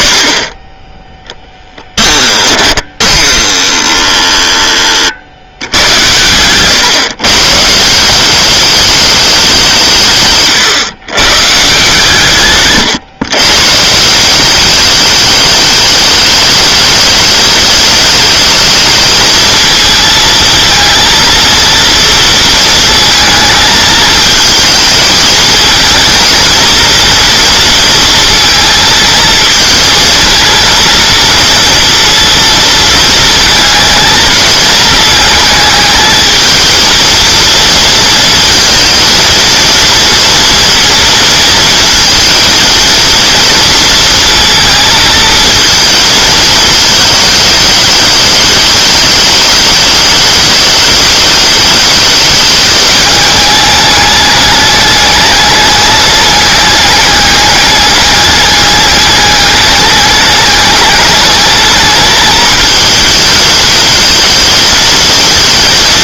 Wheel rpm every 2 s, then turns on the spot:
20, 10, 20, 130, 210, 140, 130, 200, 210, 220, 220, 230, 220, 230, 230, 230, 230, 220, 220, 230, 230, 230, 230, 220, 210, 210, 210, 210, 200, 210, 210, 220, 230.
2-4